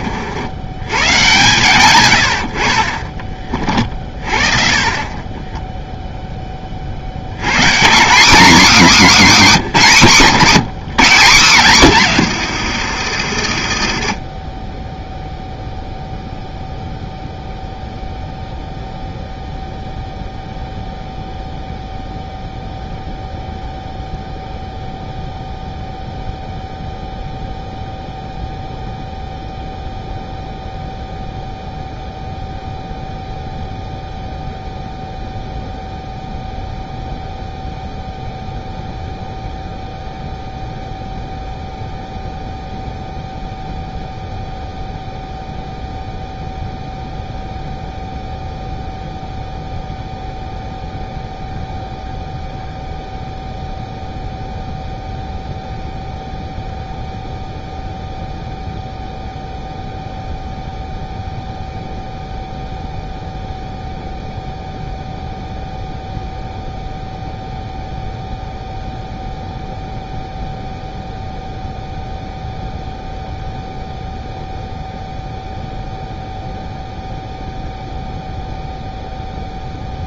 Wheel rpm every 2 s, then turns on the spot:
90, 60, 40, 20, 230, 170, 150, 30, 0, 0, 0, 0, 0, 0, 0, 0, 0, 0, 0, 0, 0, 0, 0, 0, 0, 0, 0, 0, 0, 0, 0, 0, 0, 0, 0, 0, 0, 0, 0, 0.
12-16